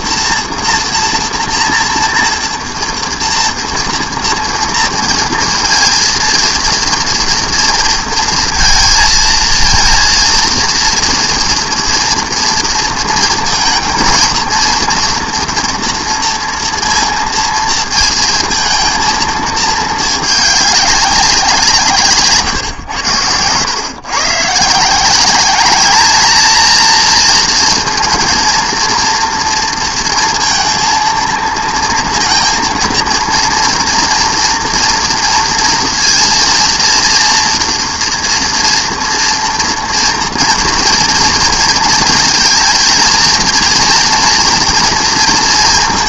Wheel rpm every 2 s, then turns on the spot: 240, 230, 230, 230, 230, 230, 230, 230, 230, 230, 200, 110, 160, 230, 230, 230, 230, 230, 230, 230, 240, 230, 240.
none